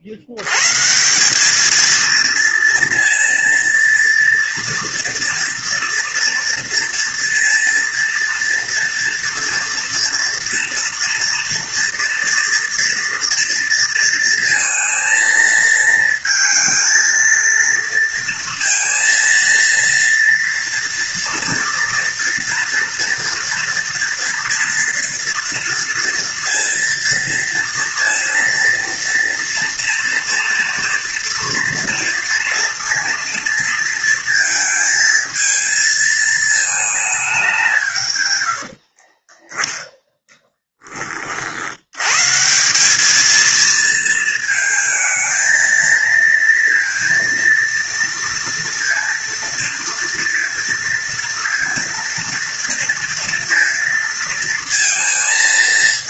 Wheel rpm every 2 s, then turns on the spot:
70, 230, 230, 240, 230, 230, 230, 230, 230, 230, 230, 240, 230, 230, 230, 230, 230, 220, 220, 90, 10, 170, 220, 230, 230, 230, 230, 220.
none